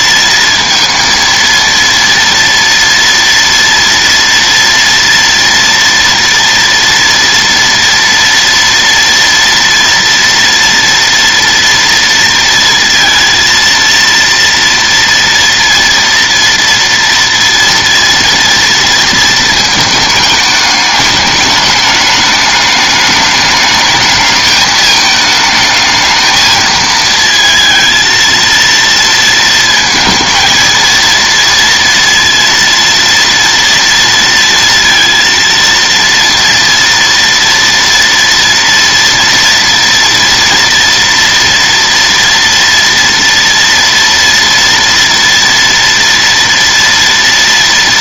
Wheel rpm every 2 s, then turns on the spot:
230, 230, 230, 230, 230, 230, 230, 230, 230, 230, 210, 210, 220, 220, 230, 230, 230, 230, 230, 230, 230, 230, 230, 230.
none